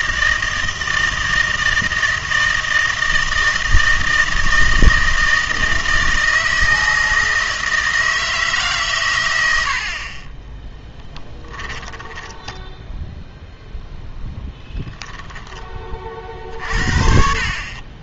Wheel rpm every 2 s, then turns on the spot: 160, 160, 160, 160, 150, 10, 10, 10, 50.
10-16